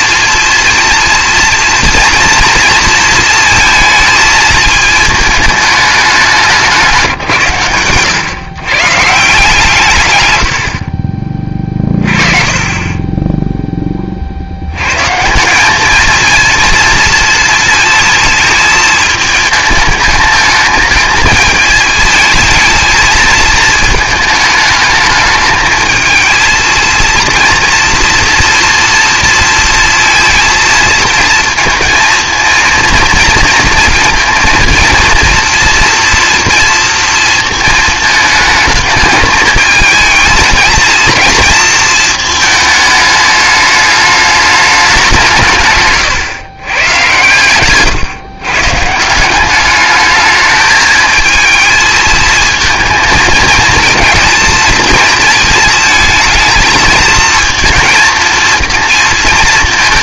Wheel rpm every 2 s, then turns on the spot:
240, 230, 220, 170, 140, 60, 20, 100, 230, 230, 220, 220, 210, 230, 230, 230, 230, 230, 230, 210, 220, 210, 210, 120, 150, 220, 230, 220, 230, 230.
none